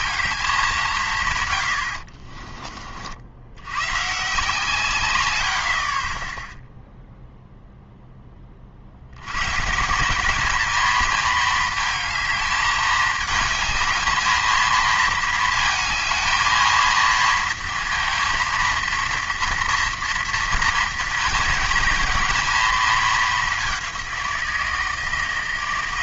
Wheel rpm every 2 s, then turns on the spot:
200, 40, 150, 0, 30, 210, 220, 220, 230, 230, 230, 220, 170.
none